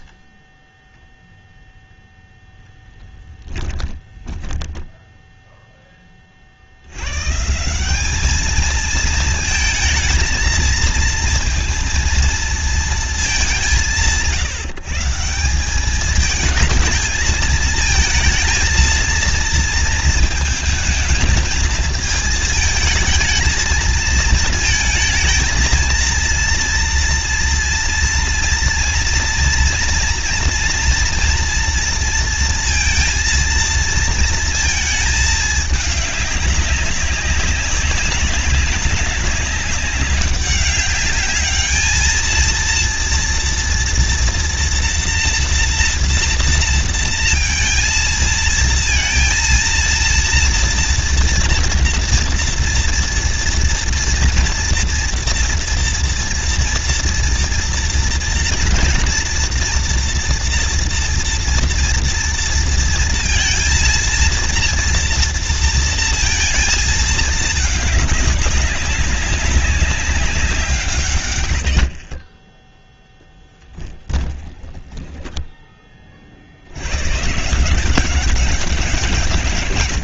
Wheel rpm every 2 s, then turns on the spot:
0, 10, 10, 60, 220, 230, 230, 150, 220, 230, 230, 220, 220, 230, 230, 230, 230, 220, 200, 200, 200, 230, 230, 230, 230, 230, 230, 230, 230, 230, 230, 230, 230, 230, 210, 190, 20, 10, 50, 190.
2-6 74-76